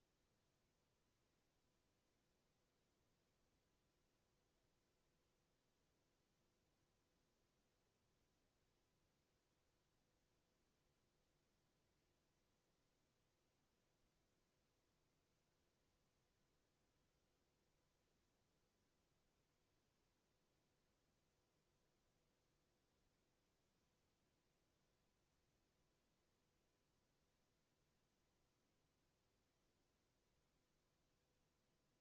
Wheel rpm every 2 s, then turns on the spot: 0, 0, 0, 0, 0, 0, 0, 0, 0, 0, 0, 0, 0, 0, 0, 0.
none